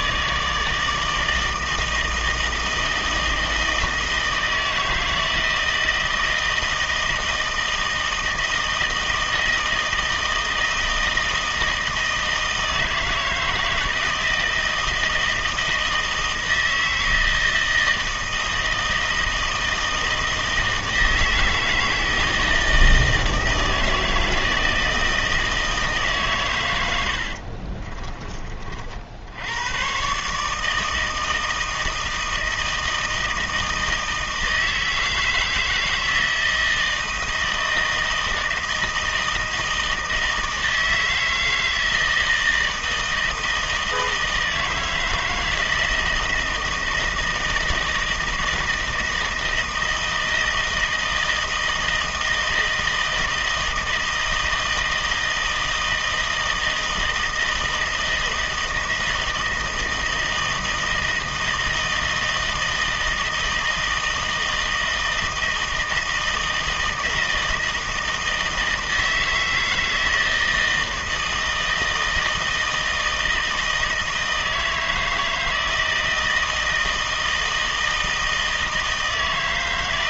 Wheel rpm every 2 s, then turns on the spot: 160, 160, 160, 160, 160, 160, 160, 160, 160, 160, 160, 160, 160, 120, 40, 150, 160, 160, 160, 160, 160, 160, 160, 160, 160, 160, 160, 160, 160, 160, 160, 160, 160, 160, 160, 160, 160, 160, 160, 160.
none